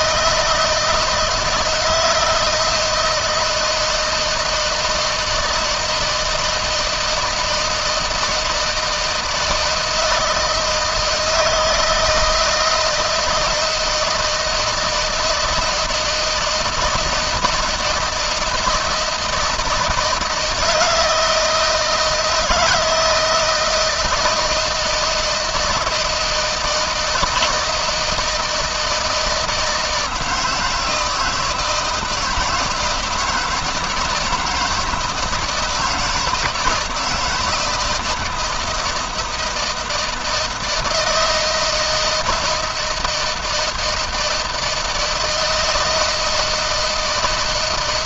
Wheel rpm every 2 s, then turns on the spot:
160, 160, 160, 160, 160, 160, 160, 160, 160, 160, 160, 160, 160, 160, 160, 160, 160, 160, 170, 160, 170, 160, 160, 160.
none